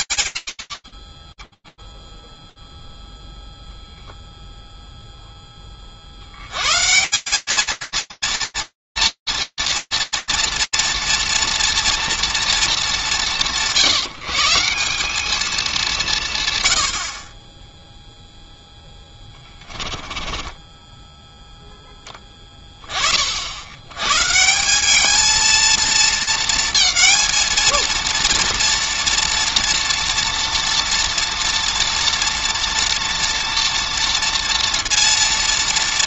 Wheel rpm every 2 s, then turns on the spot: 20, 0, 0, 170, 230, 230, 230, 160, 170, 0, 10, 20, 170, 220, 230, 230, 230, 230.
20-22